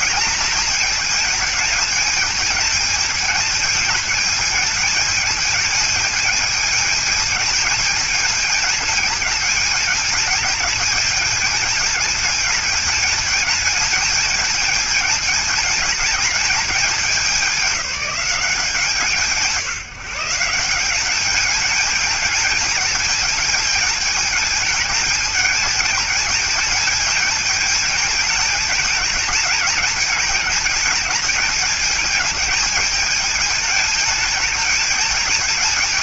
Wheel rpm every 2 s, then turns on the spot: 220, 220, 210, 220, 220, 220, 210, 220, 200, 170, 180, 220, 220, 220, 220, 210, 220, 210.
none